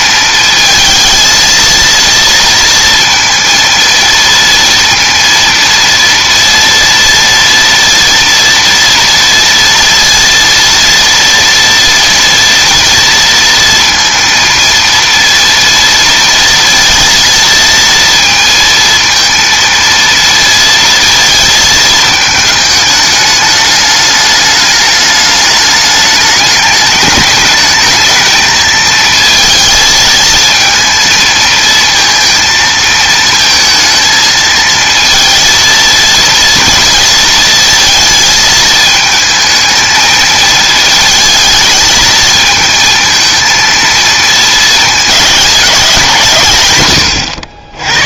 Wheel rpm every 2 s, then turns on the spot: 220, 230, 230, 230, 230, 230, 230, 230, 230, 230, 220, 210, 210, 210, 220, 220, 220, 220, 230, 220, 220, 230, 220, 120.
none